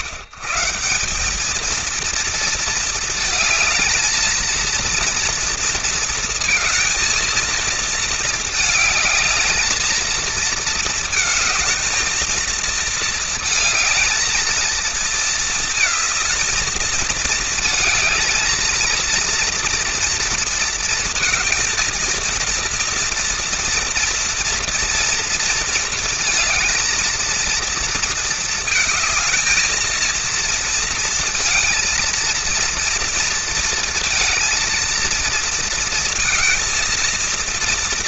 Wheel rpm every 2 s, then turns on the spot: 150, 230, 230, 230, 220, 220, 230, 220, 220, 220, 230, 230, 230, 230, 220, 230, 230, 230, 230.
none